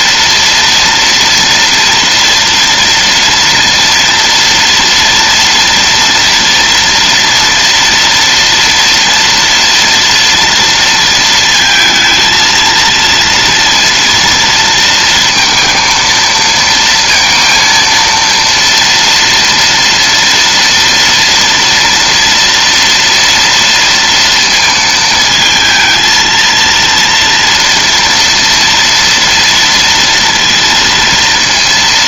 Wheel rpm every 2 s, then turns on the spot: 230, 230, 230, 230, 230, 230, 230, 230, 230, 230, 230, 230, 220, 230, 230, 230.
none